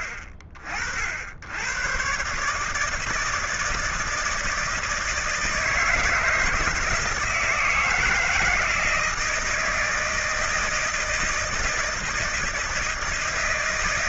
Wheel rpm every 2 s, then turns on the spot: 60, 150, 160, 160, 160, 160, 160.
none